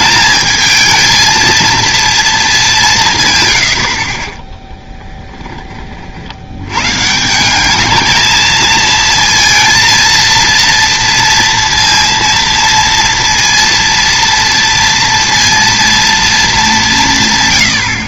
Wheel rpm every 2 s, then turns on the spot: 220, 190, 10, 120, 220, 230, 230, 230, 190.
4-6